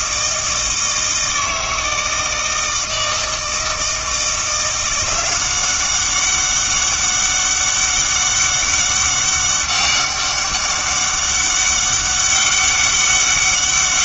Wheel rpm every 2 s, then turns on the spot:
160, 160, 180, 200, 200, 200, 200.
none